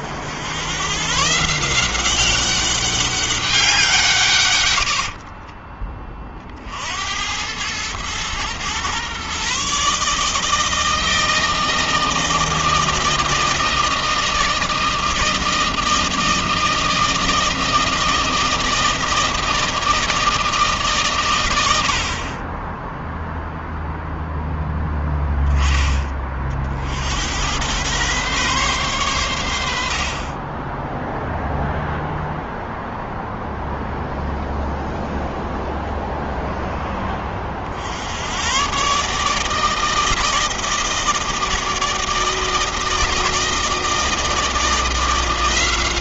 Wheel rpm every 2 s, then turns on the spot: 130, 190, 50, 80, 130, 160, 160, 160, 160, 160, 130, 0, 0, 70, 110, 10, 0, 0, 20, 140, 160, 160, 170.
4-6